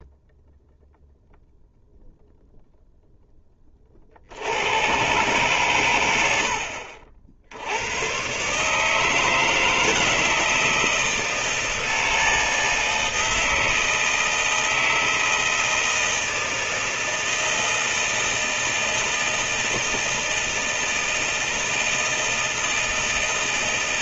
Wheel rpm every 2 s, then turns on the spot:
0, 0, 60, 100, 110, 160, 160, 160, 160, 160, 160, 160.
none